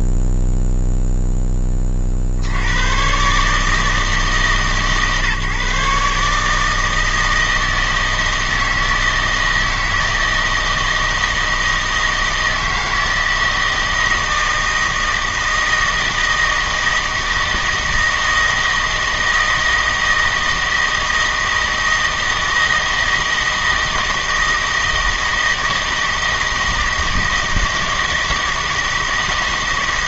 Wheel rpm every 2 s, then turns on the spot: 0, 100, 150, 160, 160, 160, 160, 160, 160, 160, 160, 160, 160, 160, 160.
none